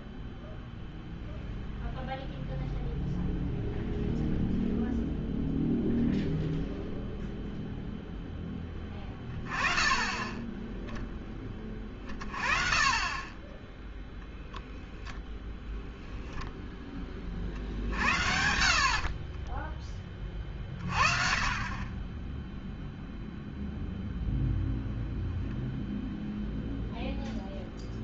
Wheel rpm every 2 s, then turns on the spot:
0, 0, 0, 0, 10, 20, 20, 10, 0, 70, 30, 0, 0, 0.
none